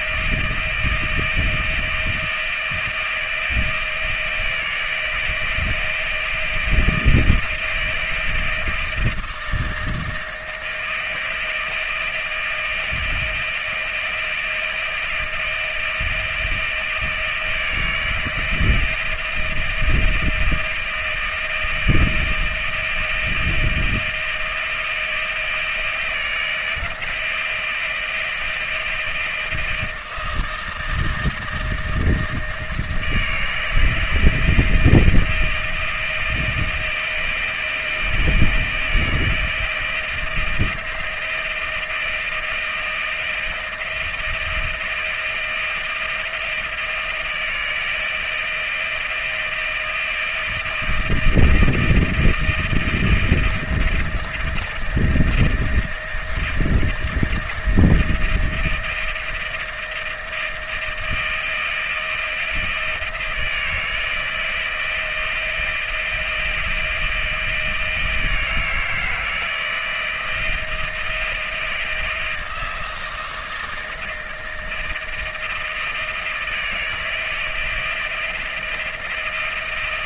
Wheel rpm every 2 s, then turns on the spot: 160, 160, 160, 160, 170, 170, 170, 160, 170, 170, 160, 160, 170, 160, 170, 160, 160, 160, 160, 160, 170, 160, 170, 160, 160, 160, 160, 160, 160, 160, 160, 160, 160, 160, 160, 170, 160, 160, 170, 160.
none